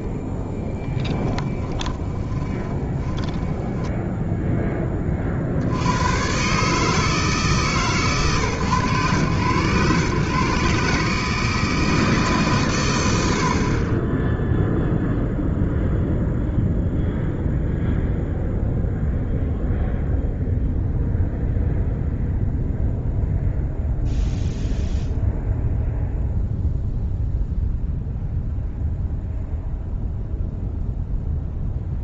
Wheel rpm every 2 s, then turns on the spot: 10, 20, 10, 150, 120, 140, 110, 0, 0, 0, 0, 0, 0, 0, 0, 0.
0-4